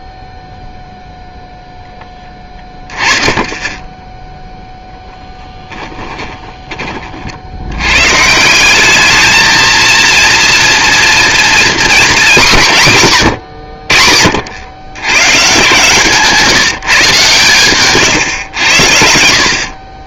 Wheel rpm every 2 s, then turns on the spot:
0, 20, 0, 20, 170, 230, 200, 80, 160, 90.
none